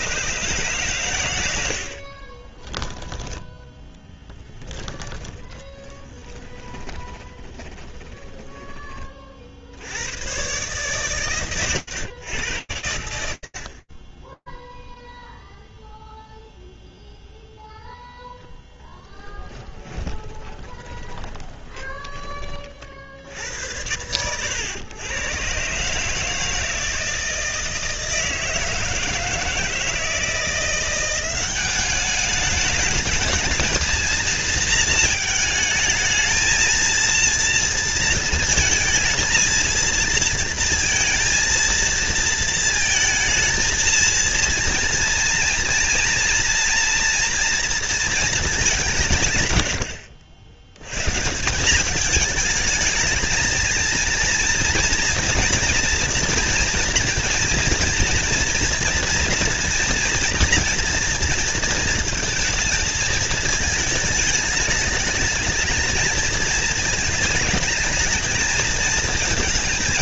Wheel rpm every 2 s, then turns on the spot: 130, 10, 20, 20, 80, 110, 100, 0, 0, 10, 30, 70, 120, 160, 160, 190, 220, 220, 230, 230, 230, 230, 230, 230, 90, 170, 220, 230, 230, 230, 230, 210, 220, 210, 220.
4-8 10-12 18-22